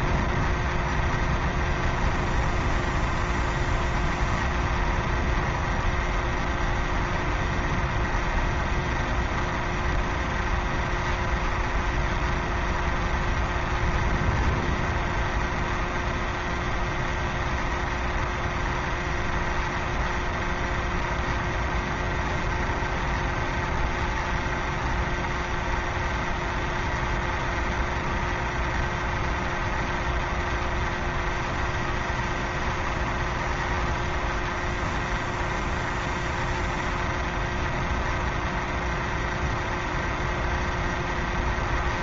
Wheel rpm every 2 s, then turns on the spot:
0, 0, 0, 0, 0, 0, 0, 0, 0, 0, 0, 0, 0, 0, 0, 0, 0, 0, 0, 0, 0.
none